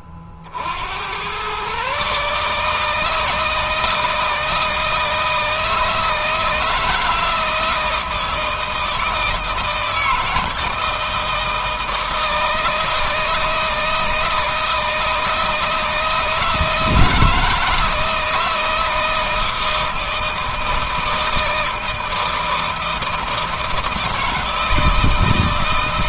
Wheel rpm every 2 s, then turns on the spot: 80, 160, 160, 160, 160, 160, 160, 160, 160, 160, 160, 160, 160.
none